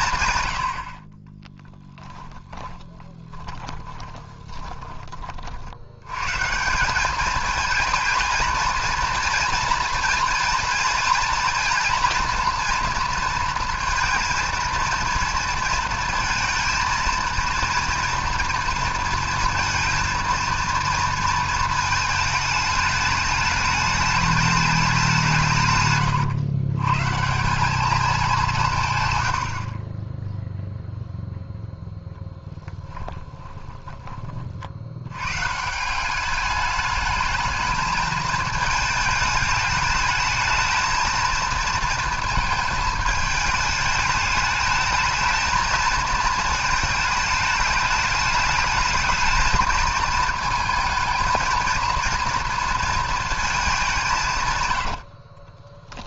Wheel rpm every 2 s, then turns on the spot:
80, 10, 20, 180, 230, 230, 240, 230, 220, 220, 230, 210, 210, 130, 150, 0, 10, 60, 210, 220, 220, 220, 220, 220, 220, 220, 230, 100.
2-4 32-34 54-56